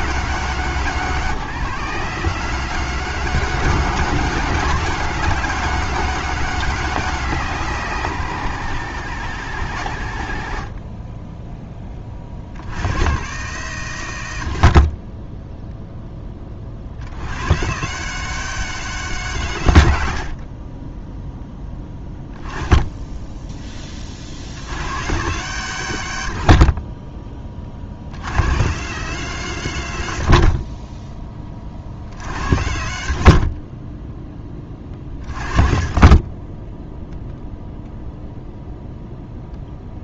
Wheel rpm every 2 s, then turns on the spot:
90, 90, 100, 90, 60, 20, 60, 20, 30, 100, 0, 10, 60, 20, 80, 10, 50, 20, 0, 0.
none